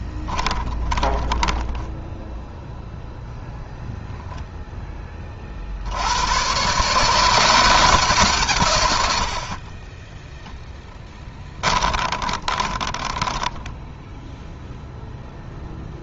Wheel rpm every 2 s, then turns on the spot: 20, 0, 10, 130, 110, 0, 10, 0.
0-2 12-14